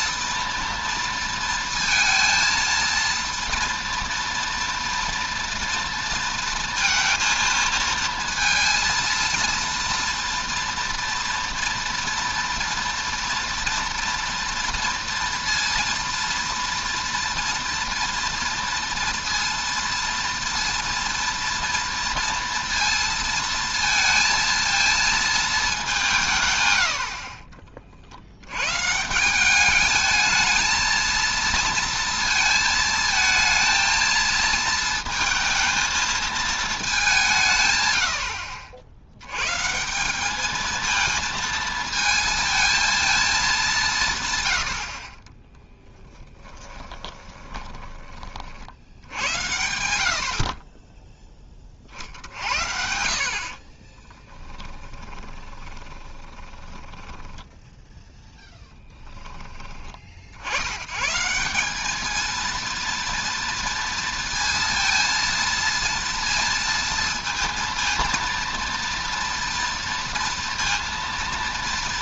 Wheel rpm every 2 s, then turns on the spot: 240, 230, 230, 230, 230, 230, 230, 230, 230, 230, 230, 230, 230, 130, 110, 220, 230, 220, 220, 60, 220, 230, 100, 30, 60, 30, 70, 10, 20, 10, 90, 230, 230, 230, 230, 230.
46-48 54-58